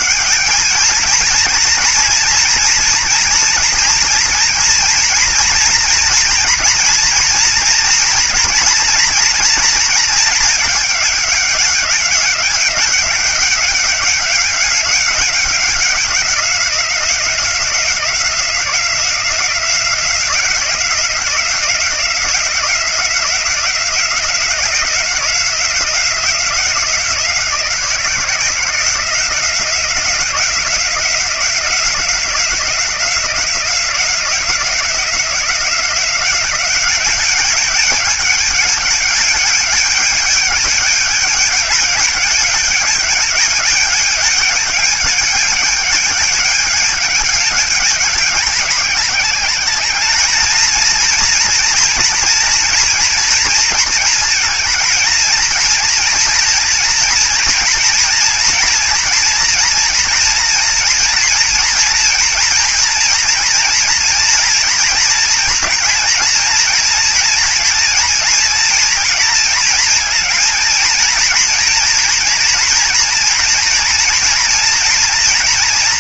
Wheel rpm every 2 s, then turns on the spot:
200, 230, 230, 230, 230, 210, 190, 200, 180, 180, 180, 180, 180, 180, 170, 180, 180, 180, 190, 210, 210, 210, 210, 210, 200, 230, 240, 230, 230, 230, 230, 230, 230, 230, 230, 220, 230, 230.
none